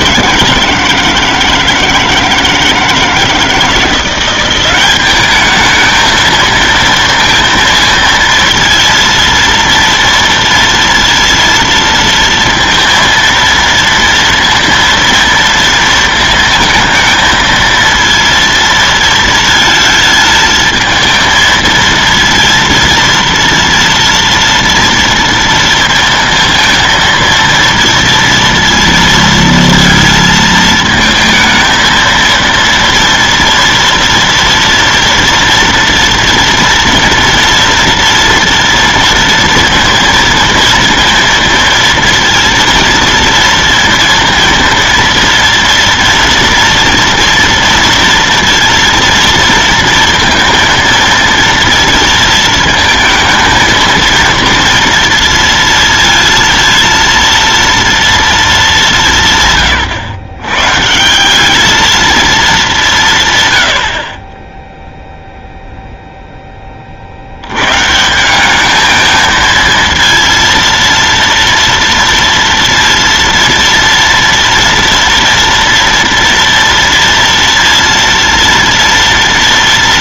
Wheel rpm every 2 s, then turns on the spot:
160, 160, 190, 220, 230, 230, 230, 230, 220, 230, 220, 230, 230, 230, 230, 220, 230, 230, 230, 230, 230, 230, 230, 230, 230, 230, 230, 230, 230, 210, 130, 200, 10, 20, 200, 230, 230, 240, 230, 230.
none